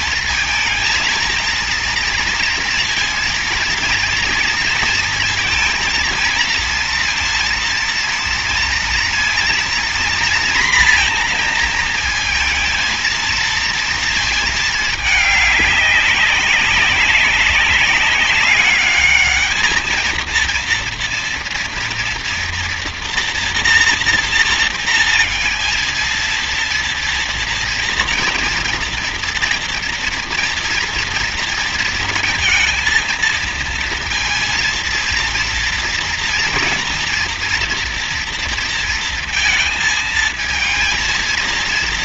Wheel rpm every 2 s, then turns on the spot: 230, 230, 230, 230, 240, 230, 230, 220, 200, 200, 230, 230, 230, 230, 240, 230, 230, 230, 230, 230, 220.
none